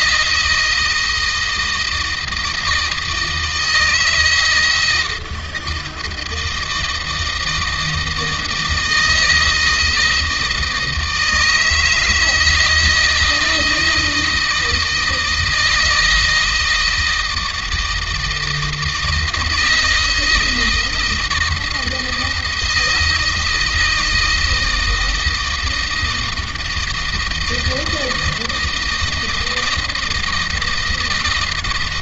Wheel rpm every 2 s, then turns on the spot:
160, 160, 160, 160, 160, 160, 160, 160, 160, 160, 160, 160, 170, 160, 160, 160.
none